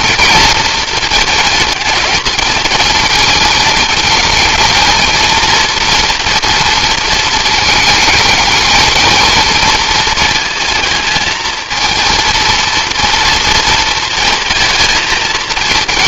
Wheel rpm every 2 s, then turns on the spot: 230, 220, 220, 230, 220, 220, 230, 220.
none